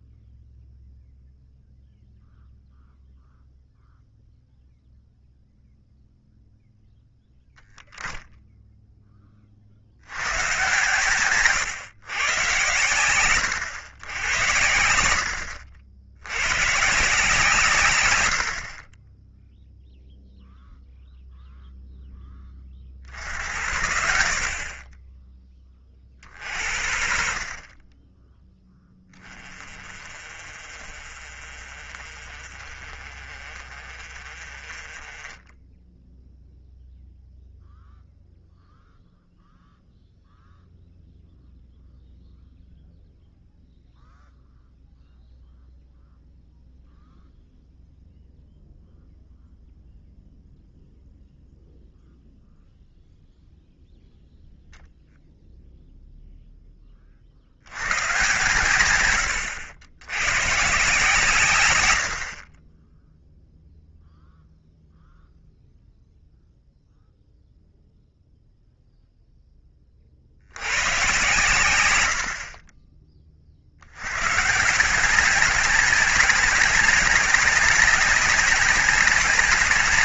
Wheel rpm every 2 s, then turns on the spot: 0, 0, 0, 0, 10, 120, 110, 80, 140, 40, 0, 40, 20, 50, 10, 40, 40, 30, 0, 0, 0, 0, 0, 0, 0, 0, 0, 0, 20, 110, 140, 20, 0, 0, 0, 100, 30, 160, 190, 200.
none